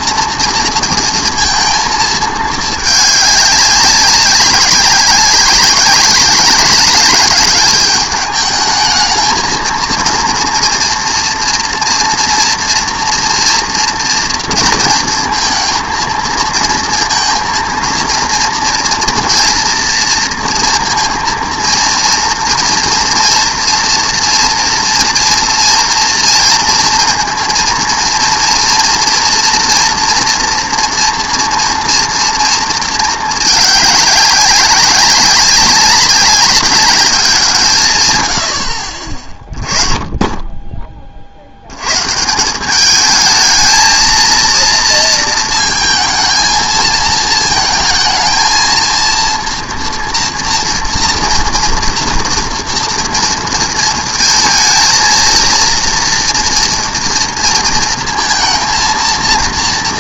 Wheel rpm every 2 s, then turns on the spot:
230, 210, 200, 190, 210, 230, 230, 230, 230, 230, 230, 230, 230, 230, 230, 230, 230, 200, 200, 70, 20, 180, 230, 220, 230, 230, 230, 220, 230, 230.
none